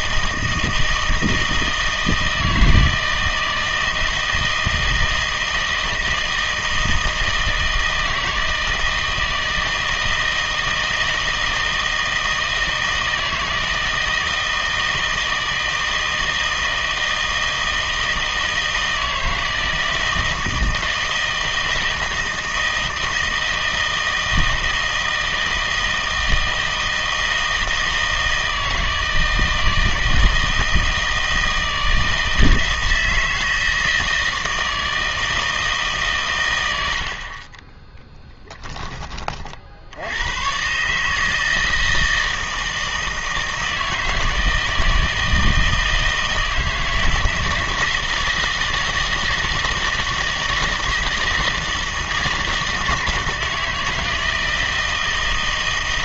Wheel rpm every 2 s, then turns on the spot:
160, 160, 160, 160, 160, 160, 160, 160, 160, 160, 160, 160, 160, 160, 160, 160, 160, 160, 90, 10, 140, 160, 160, 160, 160, 160, 160, 160.
none